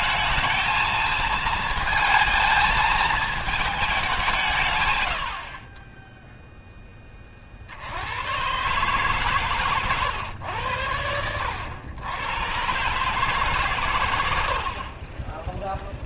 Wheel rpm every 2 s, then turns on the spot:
220, 220, 110, 10, 130, 100, 140, 40.
none